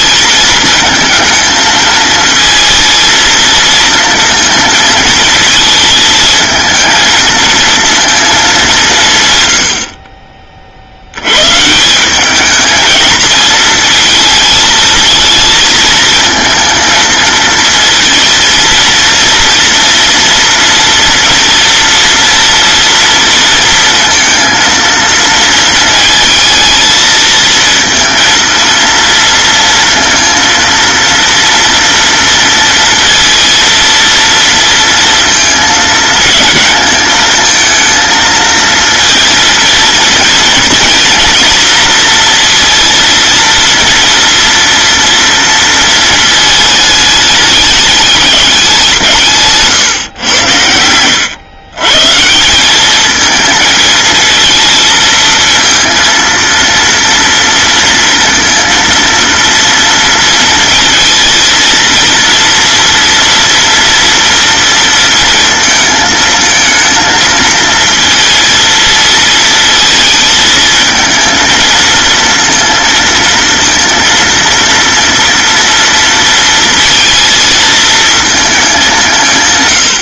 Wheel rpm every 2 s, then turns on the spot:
220, 230, 230, 220, 200, 50, 210, 220, 230, 230, 230, 230, 230, 230, 230, 230, 230, 230, 220, 230, 230, 230, 240, 220, 190, 100, 180, 230, 230, 230, 230, 230, 230, 220, 220, 220, 230, 230, 230, 210.
none